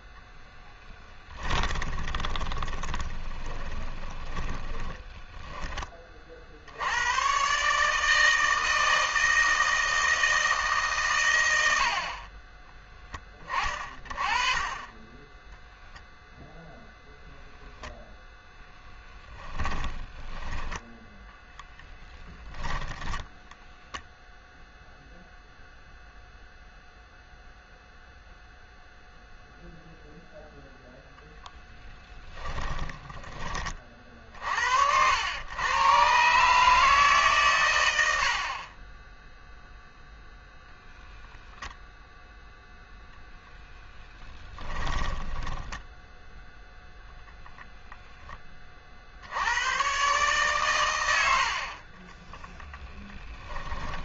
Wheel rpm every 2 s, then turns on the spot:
10, 20, 20, 80, 160, 150, 20, 20, 0, 10, 10, 10, 0, 0, 0, 0, 20, 70, 160, 40, 0, 0, 10, 0, 30, 120, 0.
0-6 18-24 32-34 44-46